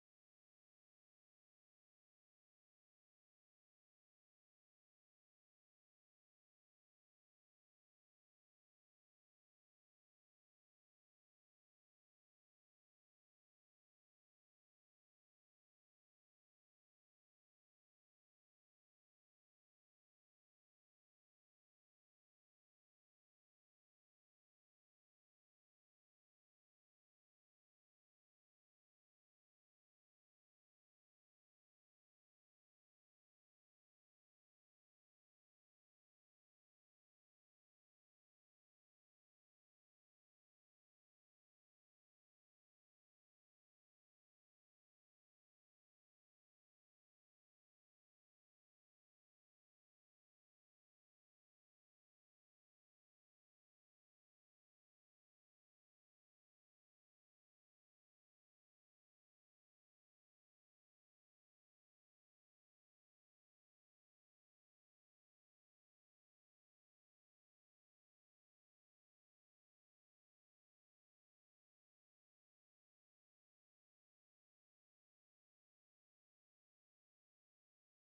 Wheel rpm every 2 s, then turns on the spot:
0, 0, 0, 0, 0, 0, 0, 0, 0, 0, 0, 0, 0, 0, 0, 0, 0, 0, 0, 0, 0, 0, 0, 0, 50, 50, 0, 0, 80, 10, 0, 0, 0, 0, 0, 10, 10, 80, 0.
58-60